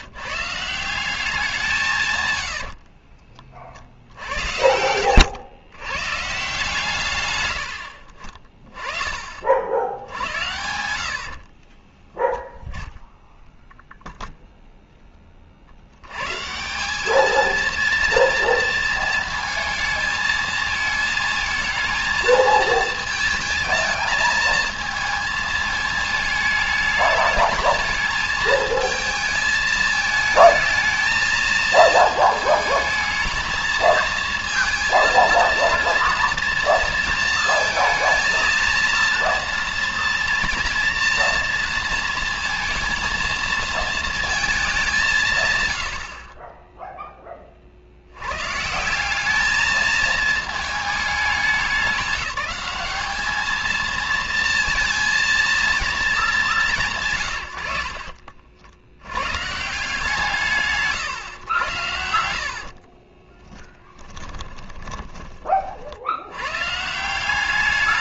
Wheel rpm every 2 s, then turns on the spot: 150, 100, 80, 140, 30, 90, 0, 0, 150, 230, 220, 220, 220, 220, 220, 220, 220, 230, 230, 230, 230, 230, 220, 20, 130, 220, 190, 230, 200, 50, 160, 60, 30, 120.
2-6 62-66